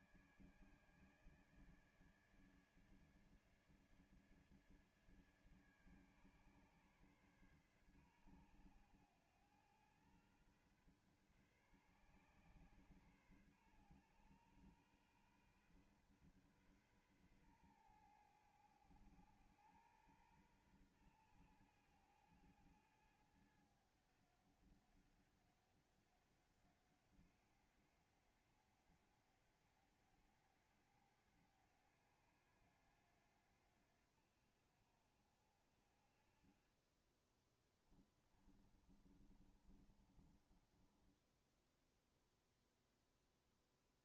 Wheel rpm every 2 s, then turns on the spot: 150, 150, 150, 140, 130, 120, 140, 130, 130, 110, 110, 110, 100, 100, 100, 100, 90, 70, 50, 20, 30, 0.
38-42